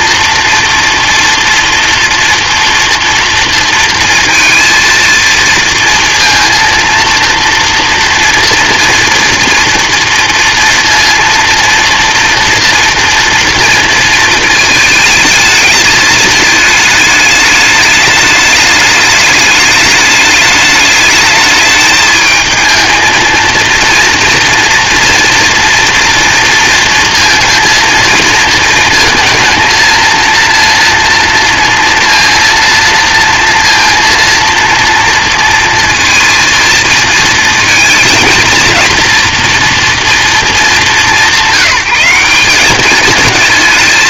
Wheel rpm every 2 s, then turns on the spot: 230, 230, 230, 230, 230, 230, 230, 220, 220, 210, 210, 220, 230, 230, 230, 230, 230, 230, 230, 230, 210, 200.
none